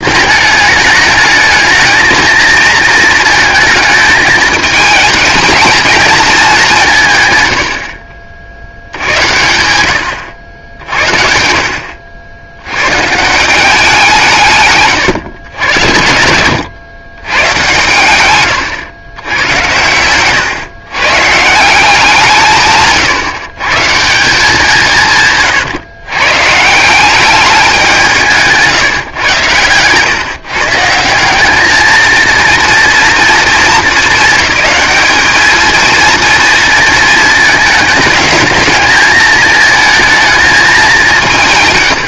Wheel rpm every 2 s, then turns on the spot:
210, 230, 220, 180, 80, 80, 100, 150, 110, 130, 130, 140, 170, 170, 150, 150, 230, 220, 230, 220, 220.
18-20